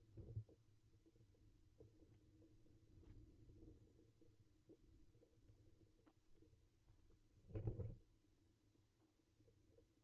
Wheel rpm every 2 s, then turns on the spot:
0, 0, 0, 0, 0.
none